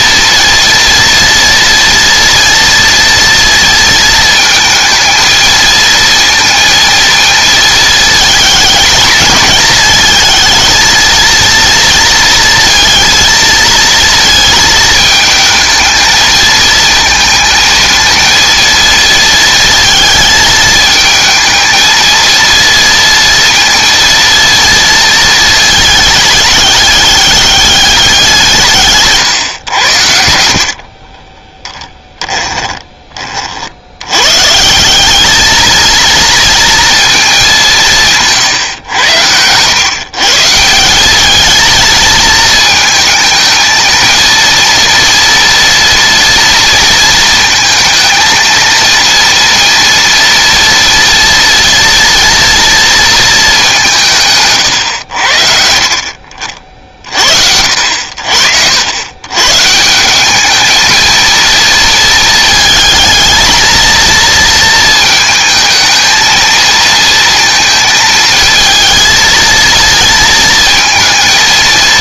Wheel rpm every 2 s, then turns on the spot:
230, 230, 230, 230, 210, 220, 230, 220, 220, 230, 220, 230, 230, 210, 170, 70, 20, 150, 230, 130, 160, 220, 230, 230, 230, 230, 230, 140, 50, 70, 220, 220, 230, 220, 220, 230.
30-34